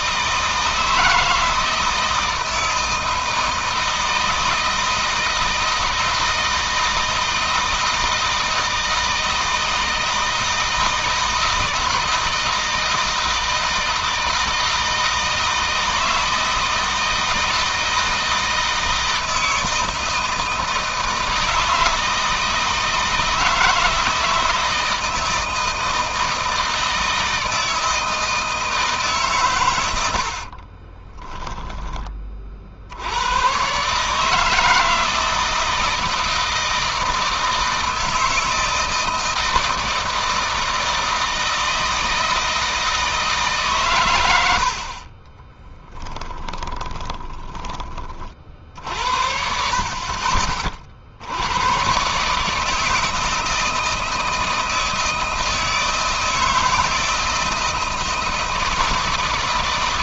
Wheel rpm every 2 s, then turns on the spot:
160, 160, 160, 160, 160, 160, 160, 160, 170, 160, 160, 160, 160, 160, 160, 50, 60, 160, 160, 160, 160, 160, 60, 30, 60, 50, 160, 160, 160, 160.
30-32 46-48